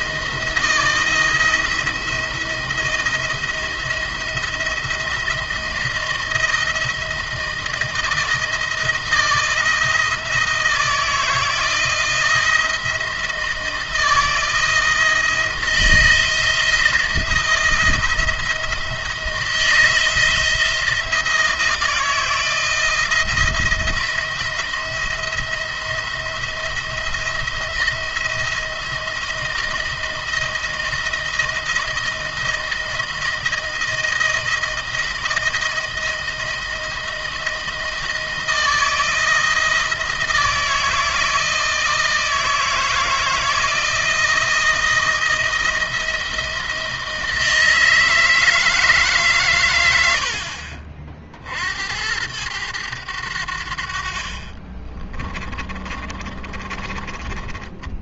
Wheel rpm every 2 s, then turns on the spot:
170, 170, 170, 170, 160, 160, 160, 160, 170, 170, 160, 160, 170, 170, 170, 170, 170, 170, 170, 160, 160, 160, 170, 160, 150, 50, 100, 30, 20.
54-58